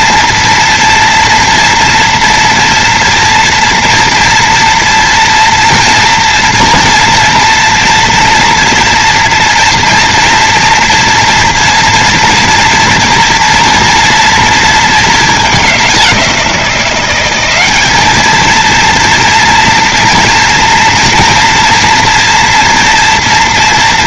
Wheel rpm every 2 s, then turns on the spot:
230, 230, 240, 230, 230, 230, 230, 220, 180, 220, 240, 230.
none